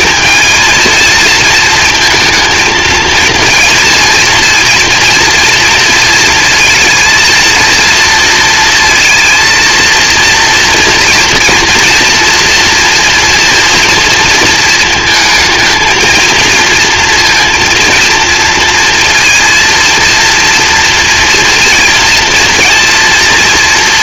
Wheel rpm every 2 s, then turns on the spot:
230, 220, 230, 230, 230, 230, 230, 220, 230, 230, 240, 230.
none